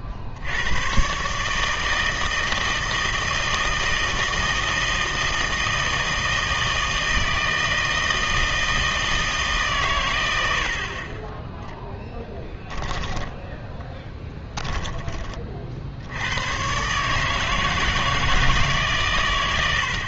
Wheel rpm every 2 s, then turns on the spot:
60, 160, 160, 160, 160, 60, 10, 10, 120, 150.
14-16